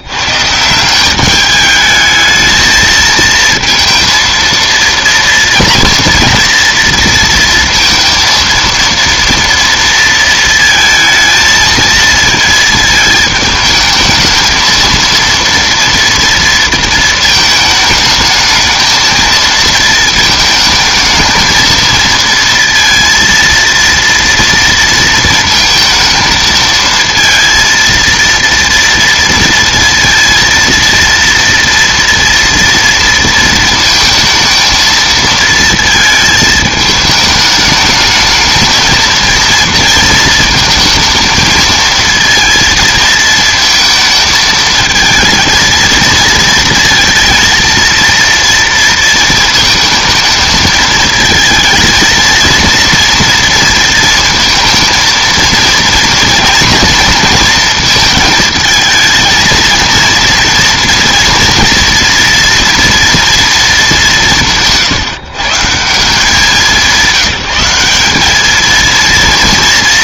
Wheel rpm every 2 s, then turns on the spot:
160, 220, 230, 230, 230, 230, 220, 220, 230, 220, 220, 230, 230, 220, 230, 230, 230, 220, 220, 220, 220, 220, 220, 230, 230, 220, 230, 230, 230, 220, 230, 240, 170, 190, 210.
none